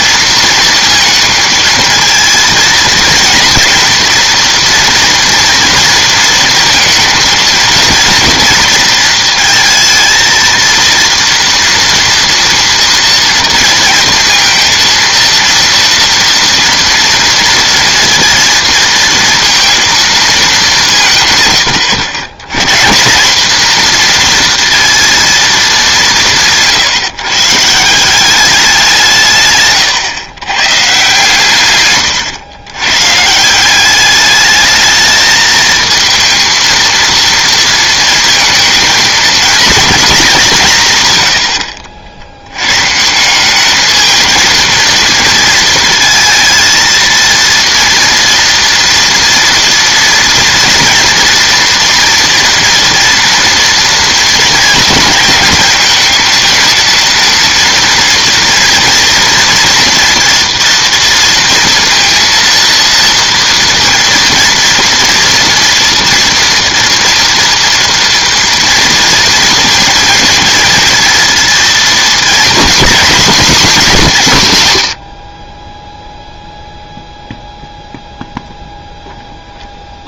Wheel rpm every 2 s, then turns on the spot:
230, 230, 230, 230, 230, 230, 230, 230, 230, 230, 200, 130, 240, 150, 190, 130, 110, 210, 230, 230, 170, 120, 230, 230, 230, 230, 240, 220, 230, 230, 230, 230, 230, 230, 230, 230, 250, 140, 0, 0.
none